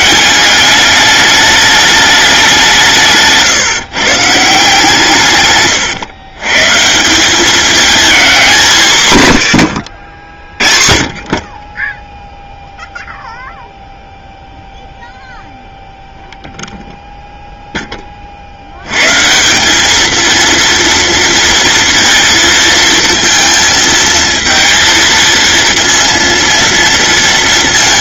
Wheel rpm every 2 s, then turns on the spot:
200, 180, 150, 140, 170, 40, 0, 0, 0, 100, 230, 230, 230, 230.
none